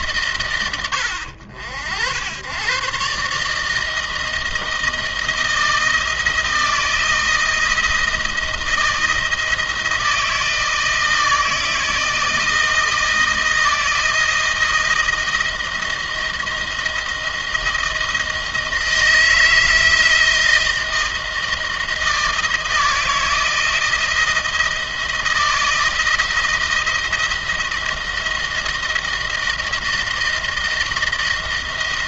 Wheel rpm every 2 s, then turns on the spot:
110, 110, 160, 160, 160, 160, 160, 160, 160, 160, 160, 160, 160, 160, 160, 160.
none